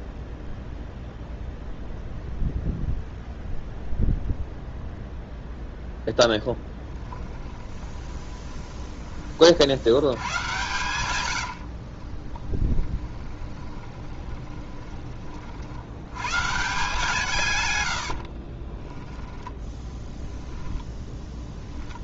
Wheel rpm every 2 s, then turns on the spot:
0, 0, 0, 10, 10, 120, 20, 20, 150, 30, 0.
6-8 12-16 18-20